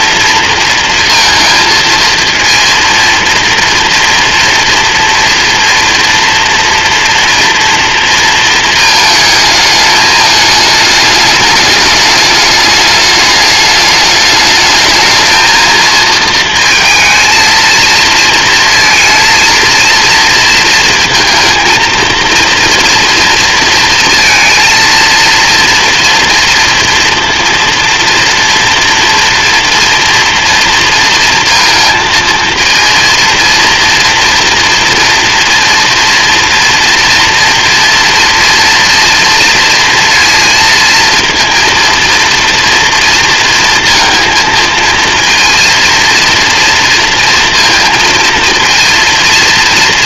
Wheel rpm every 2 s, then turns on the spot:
230, 230, 230, 230, 220, 210, 210, 220, 230, 220, 230, 230, 230, 230, 230, 230, 230, 230, 230, 230, 230, 230, 230, 230, 230.
none